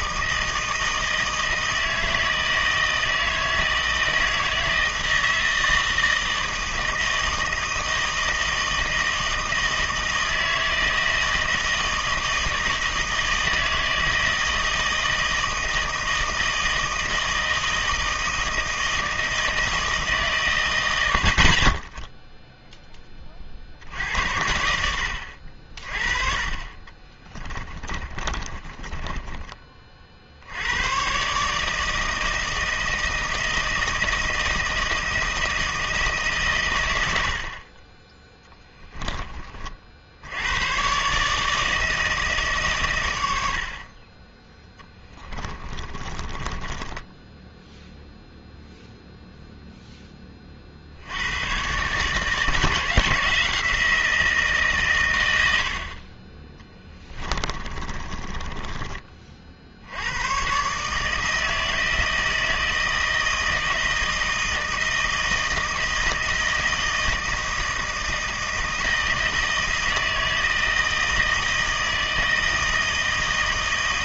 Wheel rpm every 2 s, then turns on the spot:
160, 160, 160, 160, 160, 160, 160, 160, 160, 160, 110, 10, 70, 30, 20, 100, 160, 160, 110, 10, 110, 130, 10, 20, 0, 60, 170, 140, 20, 30, 140, 160, 160, 160, 160, 160, 160.
26-30 38-40 44-48 56-60